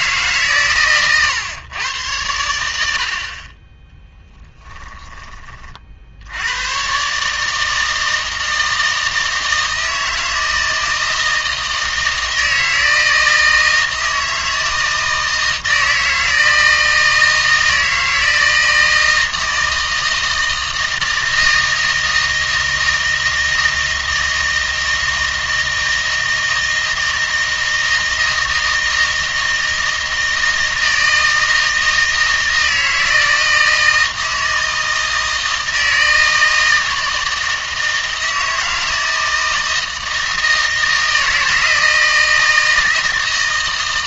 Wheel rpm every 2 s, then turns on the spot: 130, 90, 10, 110, 160, 160, 160, 160, 160, 160, 160, 160, 160, 160, 160, 160, 160, 160, 160, 160, 160, 160.
none